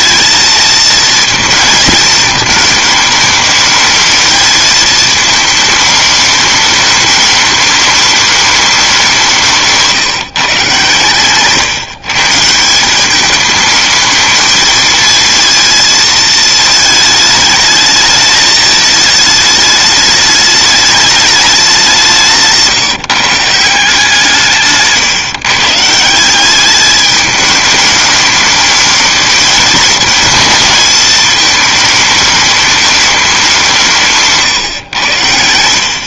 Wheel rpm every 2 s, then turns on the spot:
220, 220, 220, 210, 200, 150, 170, 220, 220, 220, 210, 150, 150, 200, 210, 220, 210, 130.
22-24